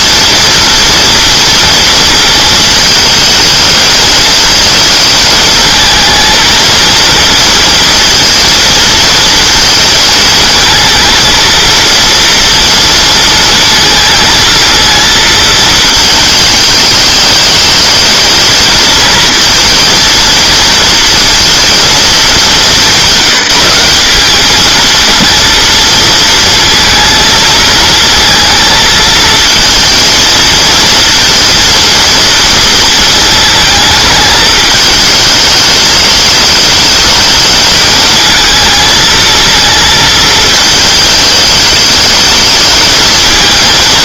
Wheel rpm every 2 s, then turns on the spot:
230, 220, 220, 230, 230, 220, 230, 230, 220, 230, 230, 200, 220, 230, 230, 230, 230, 220, 220, 220, 220, 210.
none